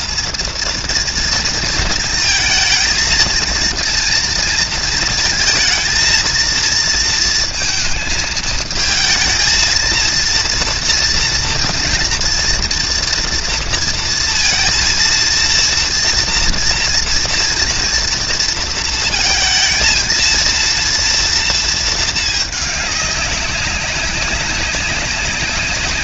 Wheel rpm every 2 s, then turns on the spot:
230, 230, 220, 230, 230, 240, 230, 230, 230, 220, 230, 190, 190.
none